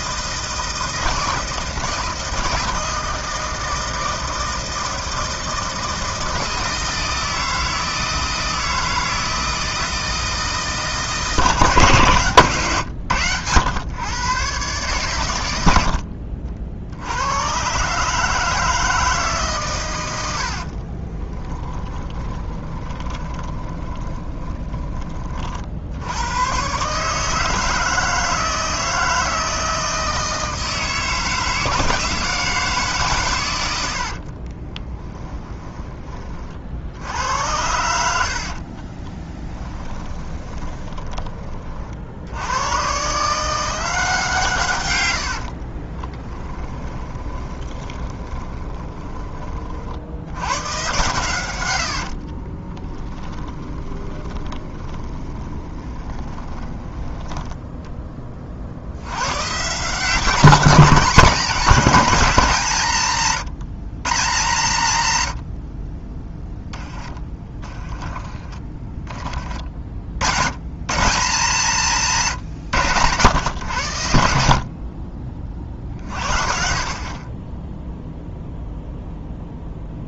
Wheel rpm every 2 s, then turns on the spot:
160, 160, 160, 160, 160, 160, 110, 130, 80, 160, 30, 20, 20, 150, 160, 160, 140, 20, 70, 30, 20, 140, 90, 20, 20, 120, 20, 20, 10, 90, 190, 160, 110, 20, 30, 160, 120, 30, 40, 0.
20-24 34-36 38-40 44-48 52-56 66-68